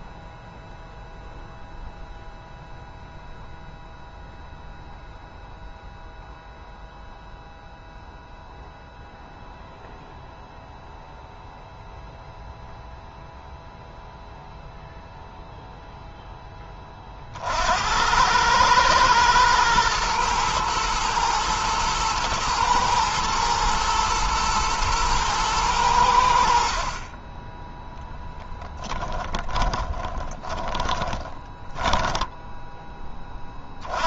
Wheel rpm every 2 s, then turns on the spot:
0, 0, 0, 0, 0, 0, 0, 0, 10, 100, 120, 110, 110, 70, 10, 20, 10.
30-34